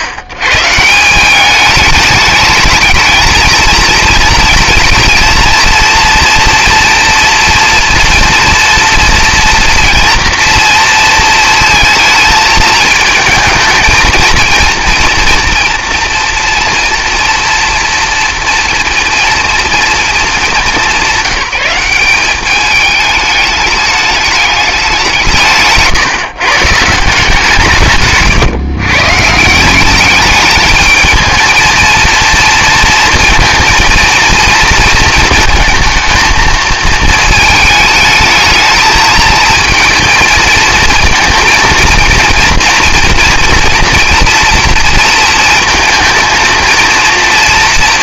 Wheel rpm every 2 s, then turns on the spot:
120, 210, 230, 240, 230, 230, 220, 230, 240, 230, 200, 210, 200, 150, 140, 210, 230, 230, 220, 220, 220, 240, 240, 230.
none